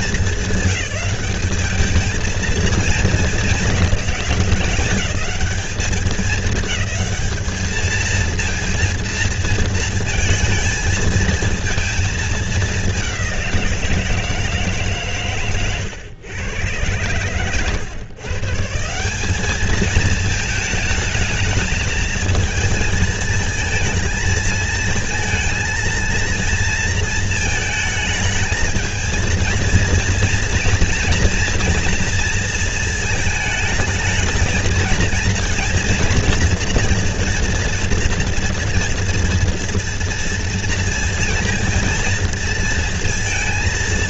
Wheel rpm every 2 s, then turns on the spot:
190, 220, 190, 210, 230, 220, 210, 150, 110, 150, 220, 220, 230, 230, 220, 230, 230, 220, 230, 240, 230, 230.
none